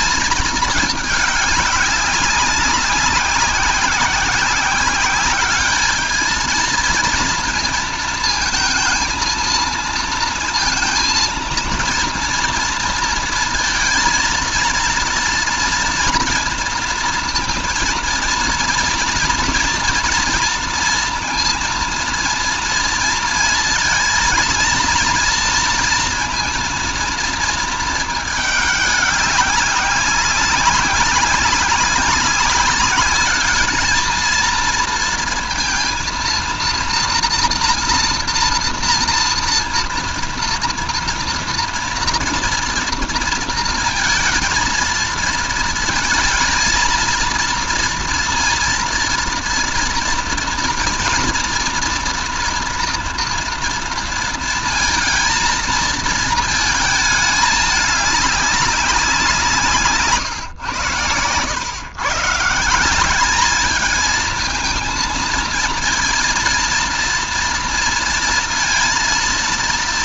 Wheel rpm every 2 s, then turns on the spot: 210, 190, 190, 220, 220, 230, 230, 230, 230, 230, 230, 230, 230, 230, 200, 190, 200, 230, 240, 230, 230, 230, 230, 230, 230, 230, 230, 230, 220, 180, 110, 190, 230, 230, 230.
none